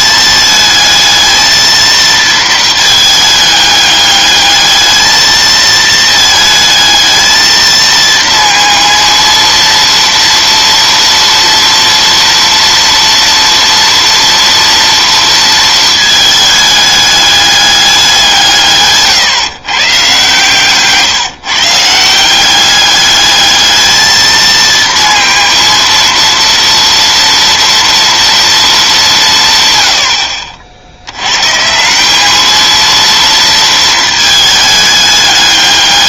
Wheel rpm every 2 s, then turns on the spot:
220, 220, 210, 220, 230, 230, 230, 230, 210, 150, 160, 200, 220, 230, 220, 60, 220, 220.
none